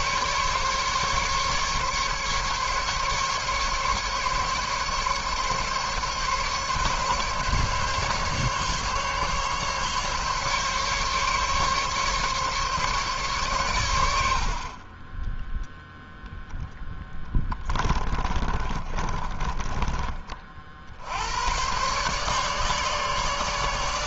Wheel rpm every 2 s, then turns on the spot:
140, 140, 150, 140, 140, 140, 140, 70, 0, 30, 40, 140.
18-20